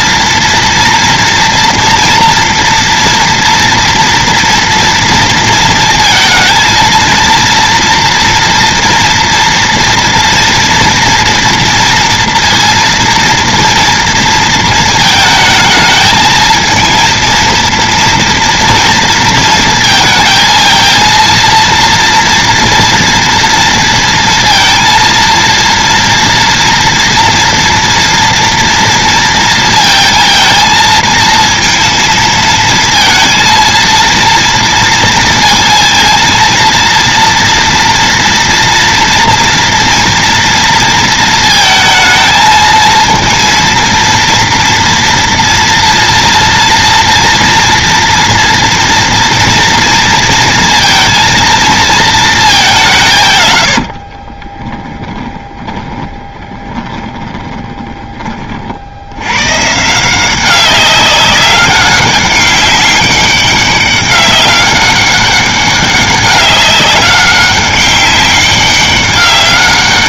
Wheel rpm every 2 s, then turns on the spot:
230, 240, 240, 230, 230, 240, 230, 230, 220, 230, 230, 230, 230, 240, 230, 230, 230, 230, 230, 240, 230, 220, 230, 230, 230, 230, 200, 20, 20, 60, 190, 200, 200, 200, 200.
54-58